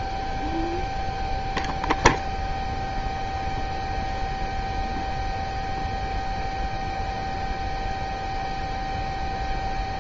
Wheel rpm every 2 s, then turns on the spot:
0, 0, 0, 0, 0.
none